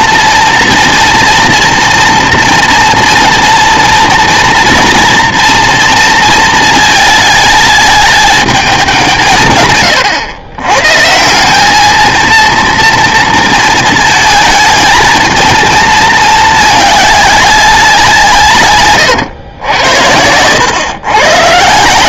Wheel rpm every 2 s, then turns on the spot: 230, 230, 230, 220, 210, 120, 230, 220, 220, 140, 110.
none